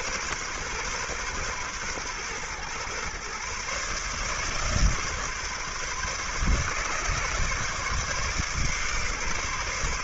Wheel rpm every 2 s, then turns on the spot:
130, 130, 150, 140, 140.
none